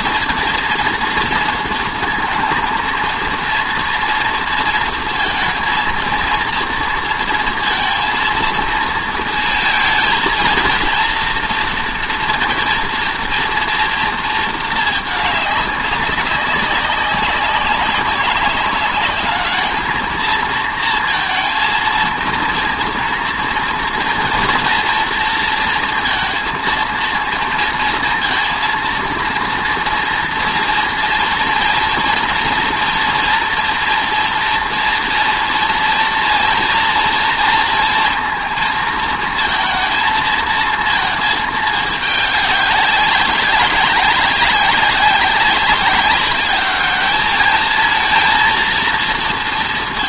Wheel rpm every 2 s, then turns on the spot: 230, 230, 230, 230, 230, 230, 230, 220, 190, 200, 230, 230, 230, 230, 230, 230, 230, 240, 230, 230, 220, 200, 190, 210, 230.
none